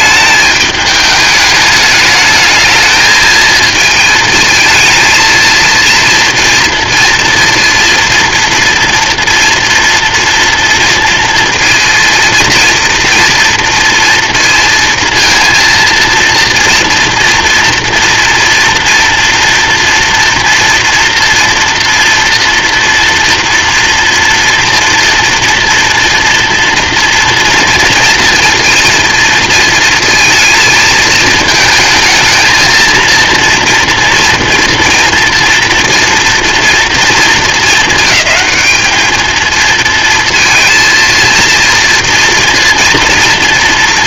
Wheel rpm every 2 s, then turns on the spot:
210, 220, 220, 230, 230, 230, 230, 230, 230, 230, 240, 230, 230, 240, 230, 230, 230, 230, 230, 210, 230, 230.
none